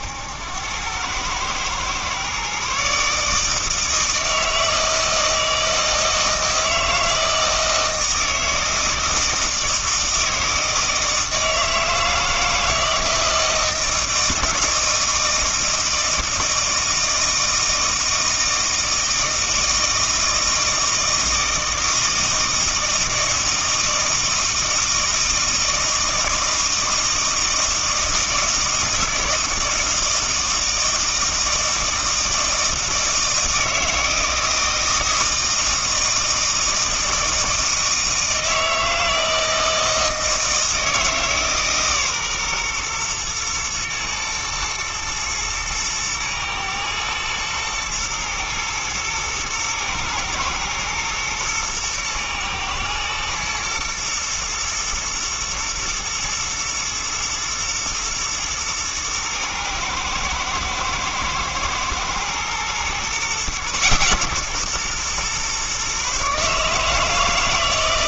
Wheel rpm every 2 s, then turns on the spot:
100, 140, 160, 160, 160, 160, 160, 160, 160, 160, 160, 160, 160, 160, 160, 160, 160, 160, 160, 160, 160, 120, 110, 110, 110, 120, 110, 120, 110, 110, 120, 120, 130, 150.
none